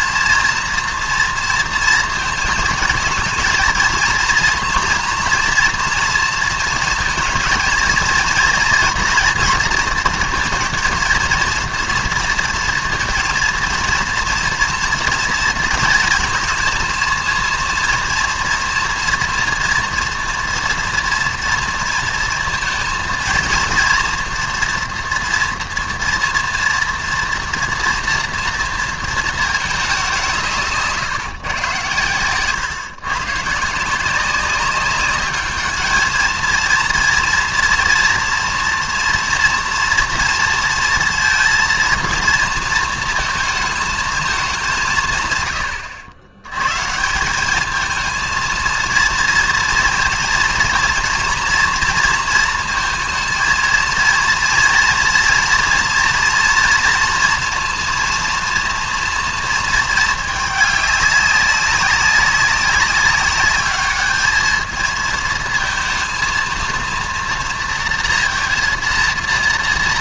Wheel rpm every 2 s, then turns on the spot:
230, 230, 230, 230, 230, 230, 230, 230, 230, 230, 230, 230, 230, 230, 230, 200, 120, 180, 220, 230, 230, 230, 220, 100, 220, 230, 230, 230, 230, 240, 210, 190, 210, 230, 230.
none